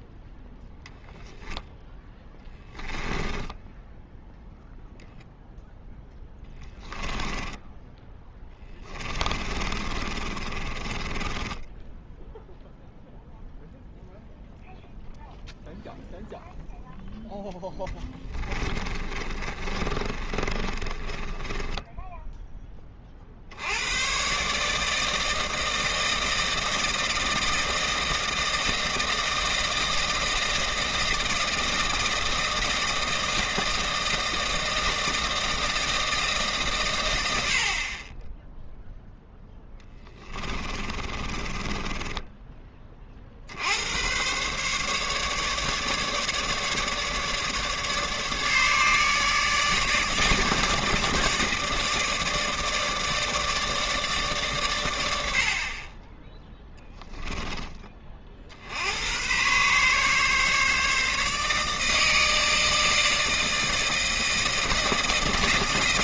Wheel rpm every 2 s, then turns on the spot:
0, 10, 0, 10, 10, 30, 0, 0, 0, 20, 30, 20, 140, 160, 160, 160, 160, 160, 140, 0, 30, 10, 130, 150, 150, 150, 160, 130, 10, 60, 140, 160, 160.
2-4 6-12 18-22 40-42